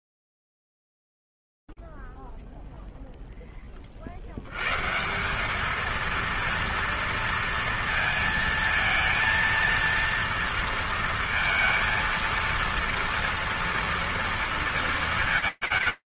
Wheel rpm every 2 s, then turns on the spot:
10, 0, 30, 210, 230, 230, 230, 230.
none